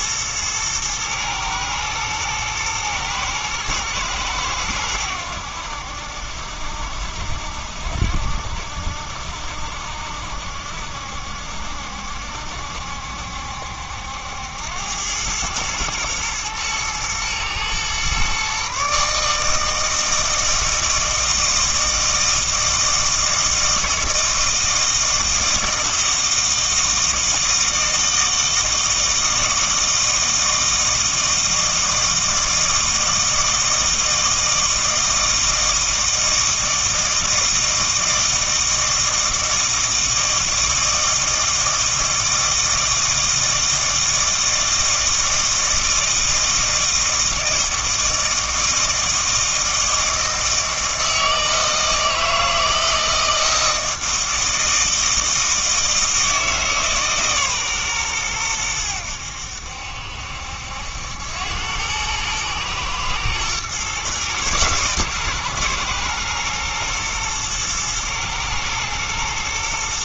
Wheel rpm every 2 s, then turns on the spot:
110, 110, 100, 70, 60, 70, 70, 90, 110, 140, 160, 160, 160, 160, 160, 160, 160, 160, 160, 160, 160, 160, 160, 160, 160, 160, 160, 160, 160, 100, 70, 110, 120, 110, 110.
none